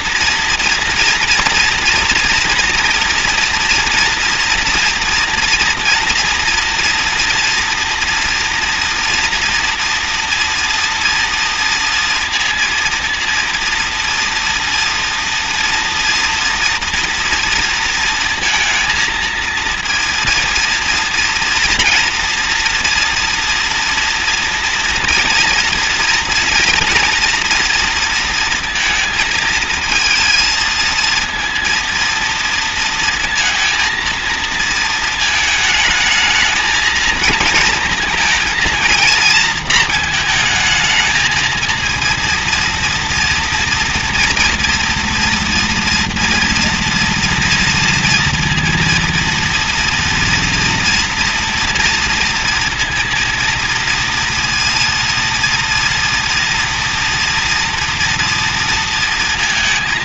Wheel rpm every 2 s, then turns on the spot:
240, 240, 230, 240, 240, 230, 230, 230, 230, 230, 230, 230, 230, 230, 230, 220, 230, 230, 220, 230, 220, 230, 230, 240, 230, 230, 230, 230, 230, 230.
none